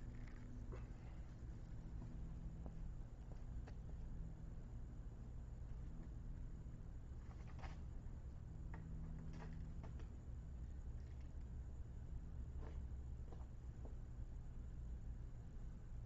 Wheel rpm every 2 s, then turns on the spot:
0, 0, 0, 0, 0, 0, 0, 0.
none